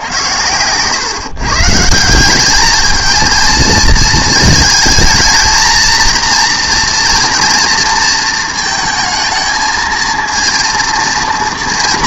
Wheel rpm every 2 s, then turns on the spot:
110, 210, 220, 230, 220, 230.
none